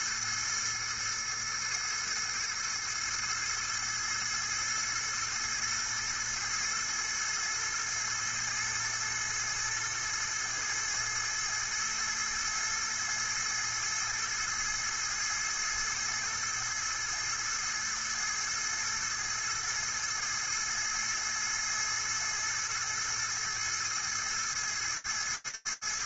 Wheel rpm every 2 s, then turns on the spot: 110, 110, 110, 110, 110, 110, 110, 110, 110, 110, 110, 110, 110.
none